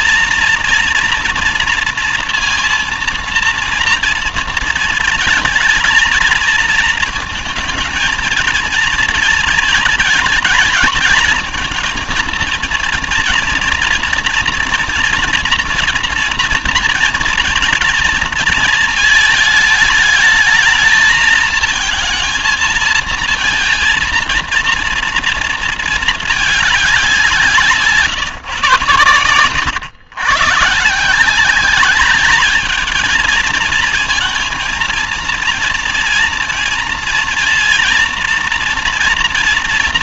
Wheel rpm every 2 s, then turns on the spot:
230, 230, 230, 230, 230, 220, 230, 230, 230, 220, 210, 230, 230, 200, 120, 140, 220, 230, 230, 230.
none